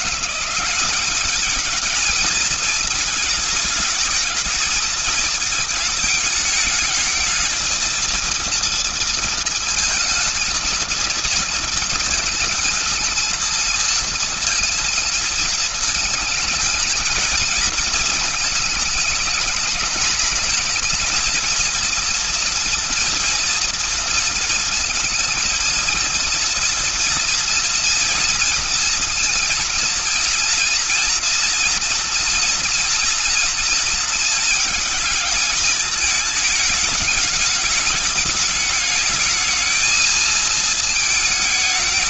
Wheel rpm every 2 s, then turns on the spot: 190, 220, 220, 210, 230, 220, 230, 230, 220, 220, 220, 230, 230, 220, 230, 230, 240, 230, 220, 210, 220.
none